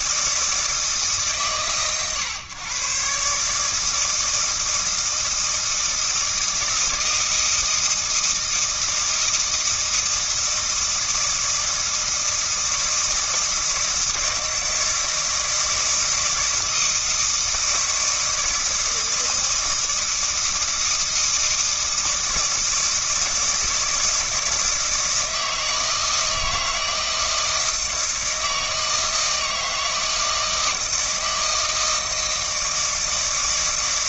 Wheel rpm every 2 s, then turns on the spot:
150, 130, 160, 160, 160, 160, 160, 160, 160, 160, 160, 160, 160, 160, 160, 160, 160.
none